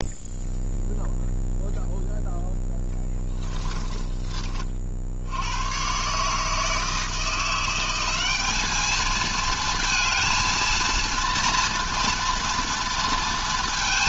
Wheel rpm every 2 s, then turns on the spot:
0, 10, 30, 150, 200, 230, 230.
none